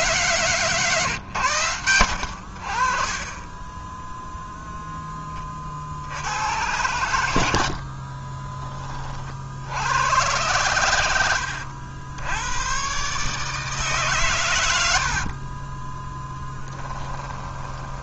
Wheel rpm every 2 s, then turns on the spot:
130, 50, 10, 90, 20, 110, 110, 90, 10.
16-18